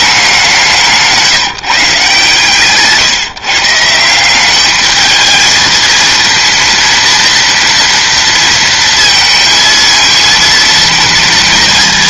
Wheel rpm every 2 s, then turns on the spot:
180, 140, 200, 230, 230, 230.
none